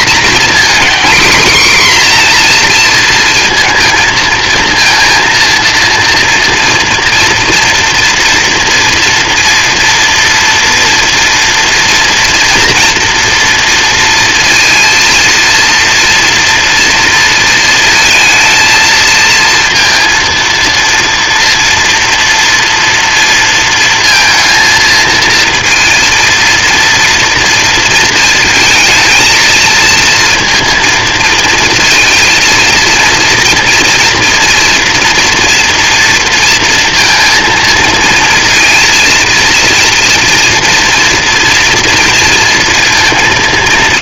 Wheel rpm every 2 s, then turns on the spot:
260, 240, 230, 230, 240, 240, 230, 230, 230, 230, 230, 230, 230, 230, 230, 230, 230, 230, 230, 230, 230, 230.
none